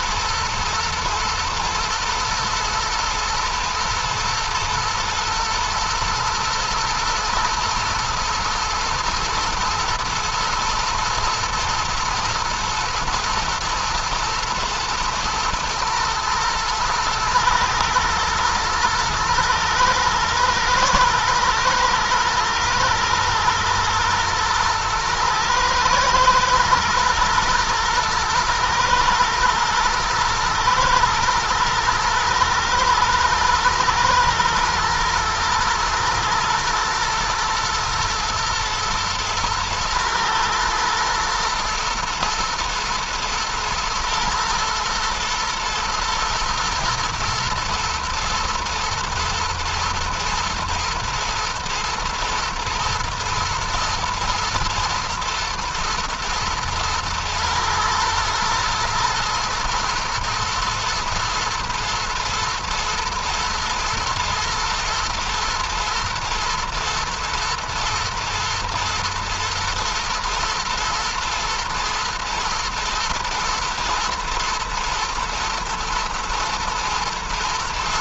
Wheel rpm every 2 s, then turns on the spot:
110, 120, 120, 110, 120, 120, 120, 110, 110, 110, 120, 110, 110, 120, 120, 110, 120, 120, 120, 110, 110, 110, 110, 110, 120, 110, 120, 120, 120, 110, 110, 110, 120, 110, 110, 110, 120, 110, 110.
none